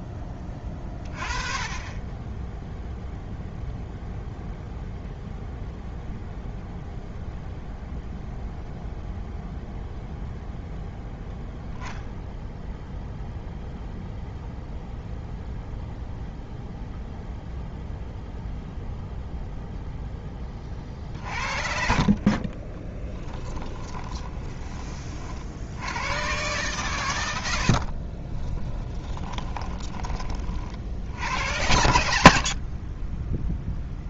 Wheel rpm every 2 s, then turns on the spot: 20, 0, 0, 0, 0, 0, 0, 0, 0, 0, 50, 20, 20, 120, 20, 60, 30.
22-24 28-30 32-34